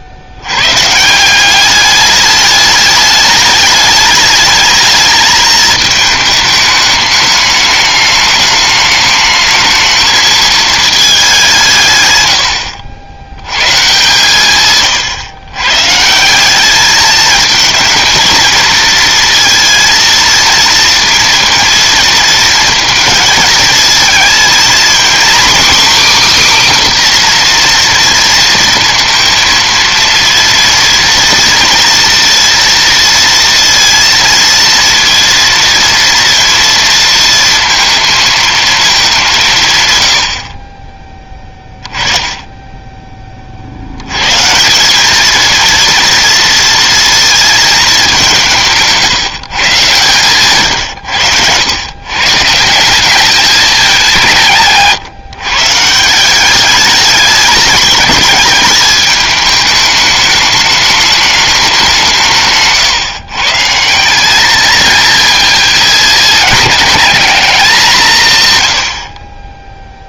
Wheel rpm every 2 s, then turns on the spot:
100, 210, 210, 210, 210, 220, 100, 130, 200, 230, 230, 230, 240, 280, 230, 230, 230, 230, 230, 220, 40, 10, 140, 230, 170, 120, 140, 170, 190, 210, 210, 150, 200, 210, 130.
none